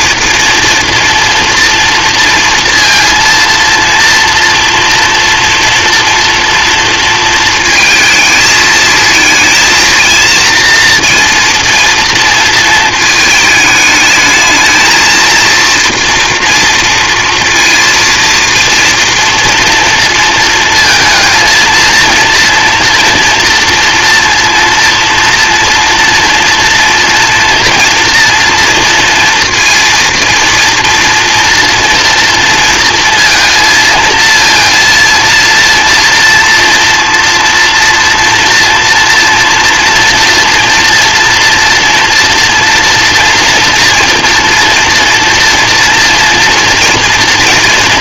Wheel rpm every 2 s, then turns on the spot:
230, 230, 230, 230, 220, 230, 230, 220, 230, 230, 230, 230, 230, 230, 230, 230, 230, 230, 240, 230, 230, 230, 230, 230.
none